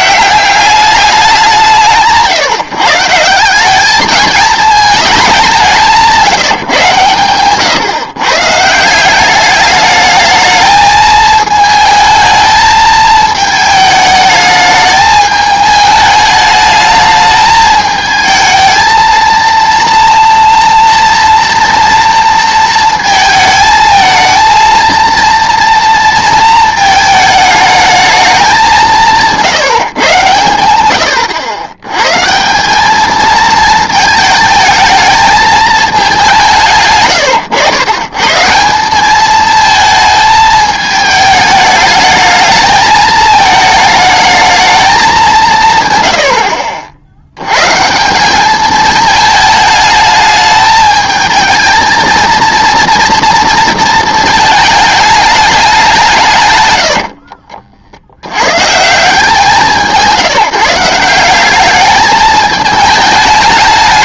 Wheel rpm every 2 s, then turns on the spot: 200, 160, 220, 150, 160, 220, 220, 220, 210, 220, 230, 230, 230, 220, 200, 110, 190, 220, 150, 180, 220, 220, 220, 60, 210, 220, 230, 220, 120, 130, 170, 210.
none